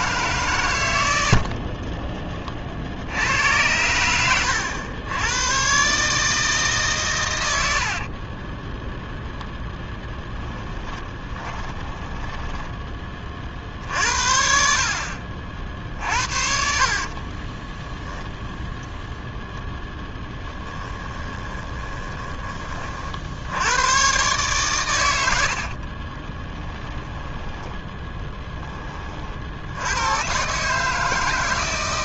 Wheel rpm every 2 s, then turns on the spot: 110, 40, 90, 150, 10, 10, 10, 50, 60, 10, 20, 40, 120, 10, 10, 150.
10-12 16-18 20-22 26-28